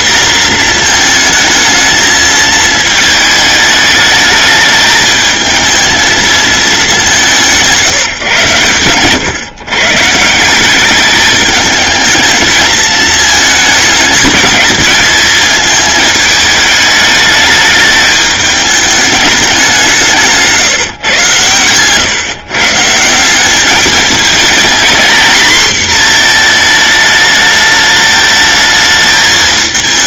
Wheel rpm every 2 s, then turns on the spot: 230, 220, 210, 210, 120, 200, 220, 220, 210, 210, 140, 160, 230, 220, 220.
none